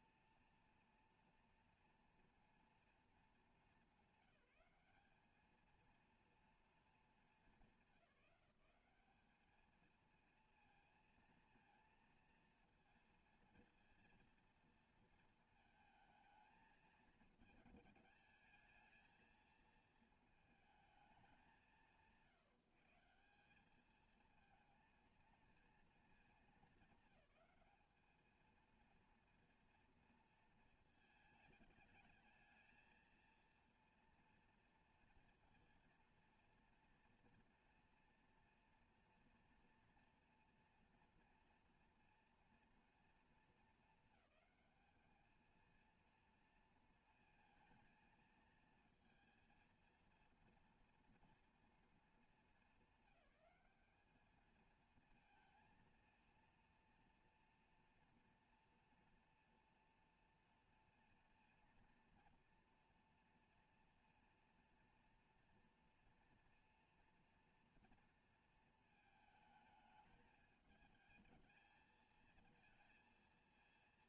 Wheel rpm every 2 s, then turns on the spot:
230, 230, 200, 230, 190, 230, 230, 230, 220, 220, 220, 150, 220, 220, 220, 220, 220, 230, 230, 230, 240, 230, 210, 230, 230, 230, 220, 220, 230, 240, 230, 230, 230, 240, 230, 210, 220.
none